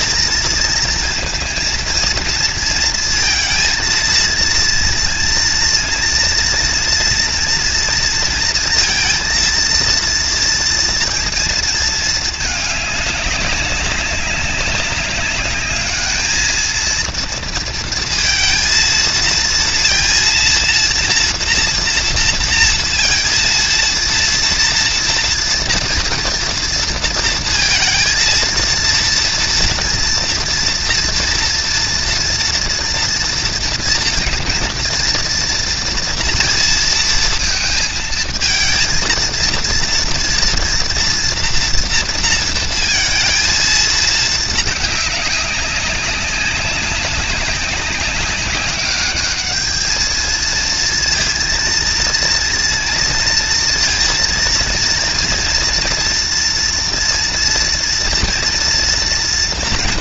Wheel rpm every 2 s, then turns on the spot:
230, 230, 230, 230, 230, 230, 210, 200, 230, 230, 230, 230, 230, 230, 230, 230, 240, 230, 230, 230, 240, 230, 210, 200, 200, 220, 230, 230, 240, 230.
none